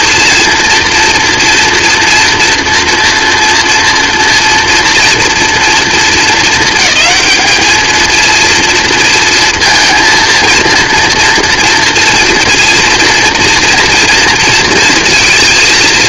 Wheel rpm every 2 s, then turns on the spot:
240, 230, 230, 220, 220, 230, 230, 230.
none